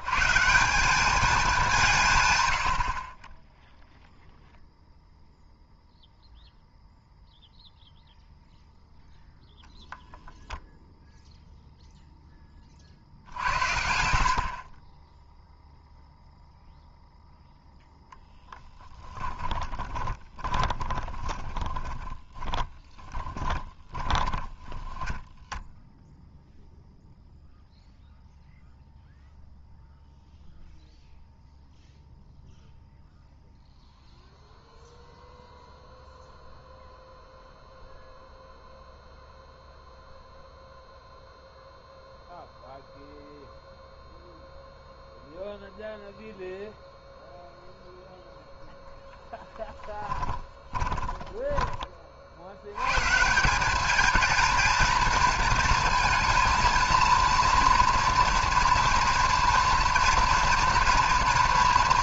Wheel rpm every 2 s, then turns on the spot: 190, 70, 0, 0, 0, 0, 30, 40, 0, 10, 20, 20, 10, 0, 0, 0, 0, 0, 0, 0, 0, 0, 0, 0, 0, 20, 100, 230, 230, 230, 230.
20-26 50-52